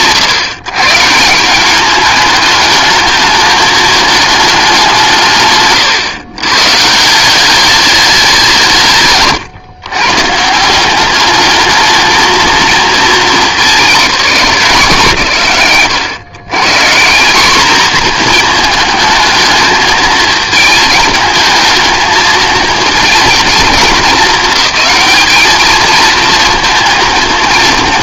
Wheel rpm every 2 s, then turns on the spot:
130, 220, 180, 140, 150, 180, 220, 180, 150, 220, 220, 220, 220, 230.
none